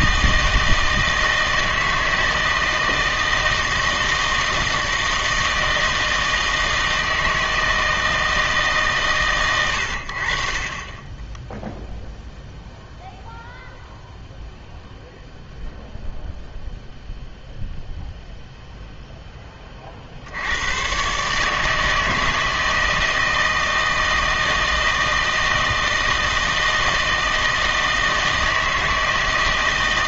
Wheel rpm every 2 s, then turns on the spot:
160, 160, 160, 160, 150, 40, 0, 0, 0, 0, 100, 160, 160, 160, 160.
none